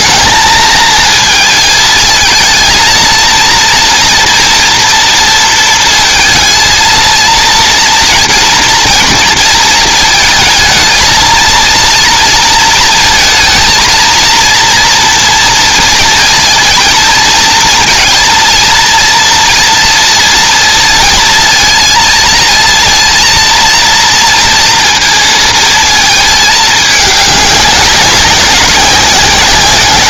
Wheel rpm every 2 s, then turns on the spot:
220, 220, 240, 230, 230, 220, 230, 230, 230, 230, 230, 230, 230, 210, 190.
none